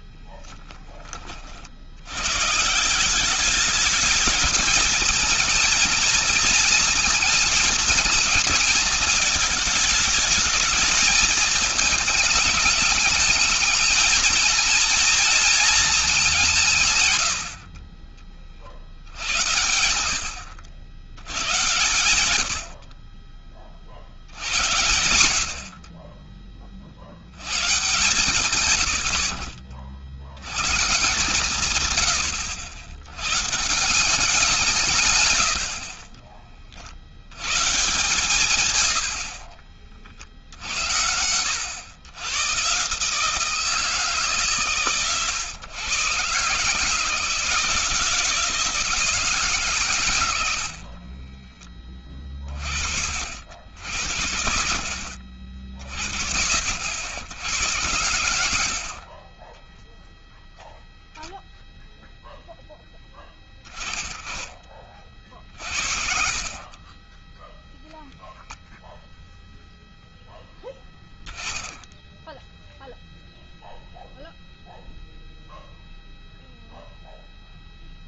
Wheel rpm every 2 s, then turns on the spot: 20, 110, 220, 230, 220, 210, 210, 220, 210, 40, 80, 90, 70, 40, 110, 130, 100, 160, 50, 90, 90, 140, 130, 150, 160, 50, 60, 60, 90, 40, 0, 10, 40, 20, 0, 10, 0, 0, 0.
38-40 50-52 58-60